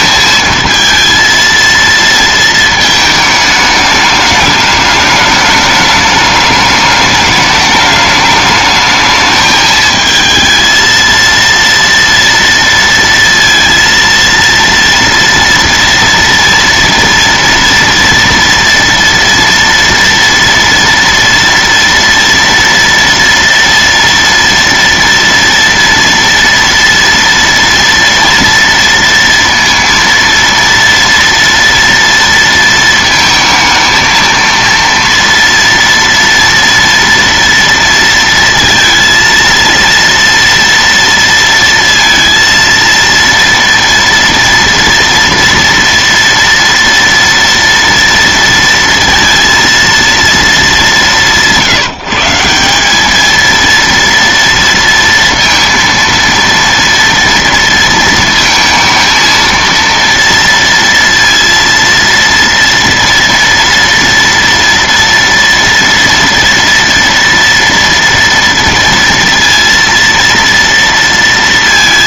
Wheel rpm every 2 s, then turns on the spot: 220, 220, 210, 210, 210, 220, 230, 230, 230, 230, 230, 230, 230, 230, 230, 230, 230, 230, 230, 230, 230, 230, 230, 230, 230, 220, 180, 230, 230, 230, 230, 230, 230, 230, 230, 230.
none